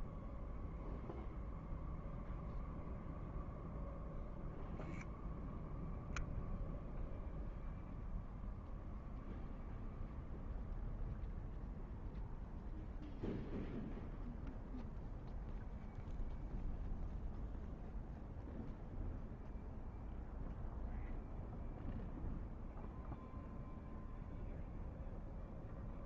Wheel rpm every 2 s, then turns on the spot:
0, 0, 0, 0, 0, 0, 0, 0, 0, 0, 0, 0, 0.
none